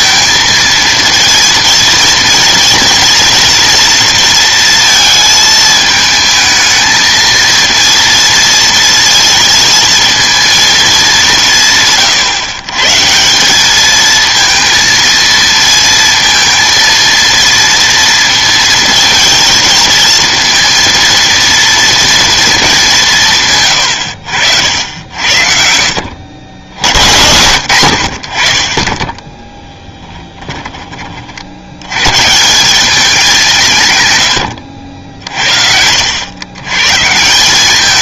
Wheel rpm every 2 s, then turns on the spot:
230, 230, 230, 220, 230, 220, 120, 230, 230, 230, 230, 220, 90, 80, 50, 20, 170, 90, 110.
30-32 34-36